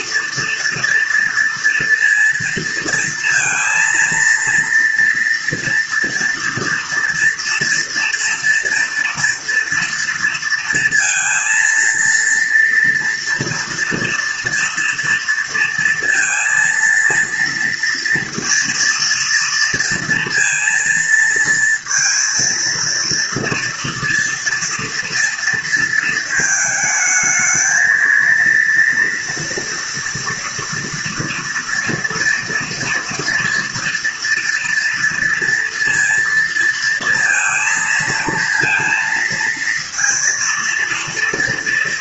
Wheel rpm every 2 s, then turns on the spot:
230, 230, 230, 240, 240, 230, 230, 230, 230, 230, 230, 230, 230, 220, 240, 230, 230, 230, 230, 230, 230.
none